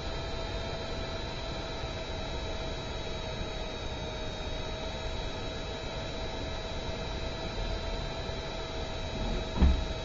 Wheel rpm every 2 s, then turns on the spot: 0, 0, 0, 0, 0.
none